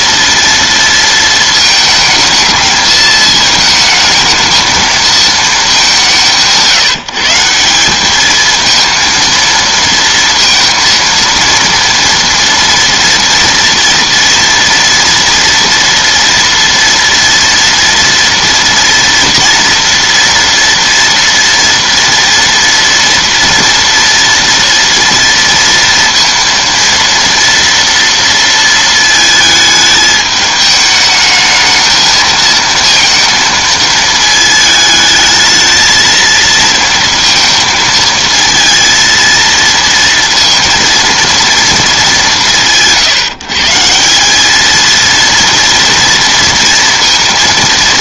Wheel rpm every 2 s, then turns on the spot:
230, 220, 220, 160, 220, 230, 230, 240, 230, 230, 230, 230, 230, 230, 230, 210, 220, 220, 230, 230, 230, 120, 220, 230.
none